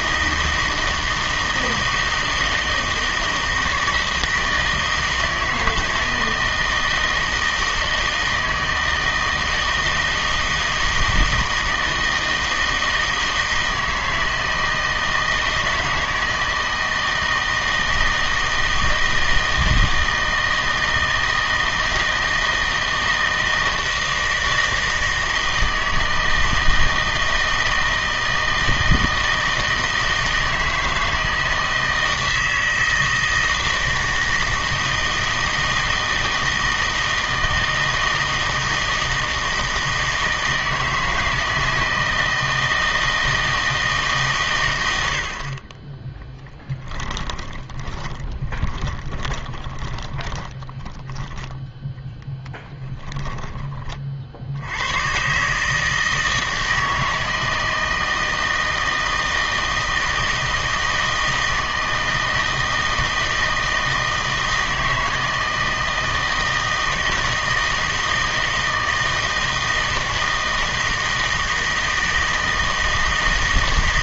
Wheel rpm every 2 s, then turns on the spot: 160, 160, 160, 160, 160, 160, 160, 160, 160, 160, 160, 160, 160, 160, 160, 160, 160, 160, 160, 160, 160, 160, 100, 10, 20, 20, 0, 80, 160, 160, 160, 160, 160, 160, 160, 160, 160.
46-52